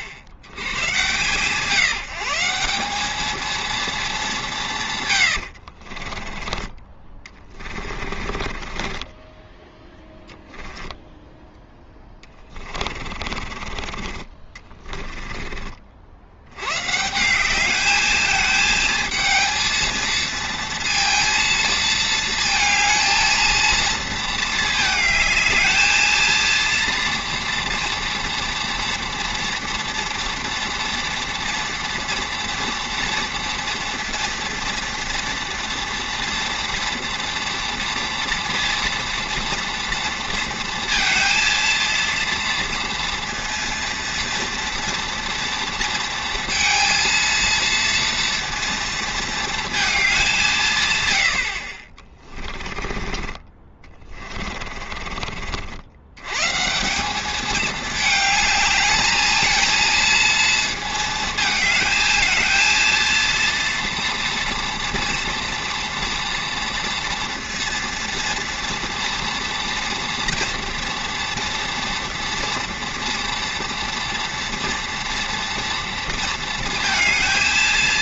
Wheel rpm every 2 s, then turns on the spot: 80, 190, 170, 20, 30, 0, 30, 30, 120, 220, 220, 220, 220, 230, 230, 230, 230, 230, 230, 230, 230, 230, 230, 230, 230, 150, 30, 30, 160, 220, 220, 230, 230, 230, 230, 230, 230, 230, 230.
8-10 12-16 52-56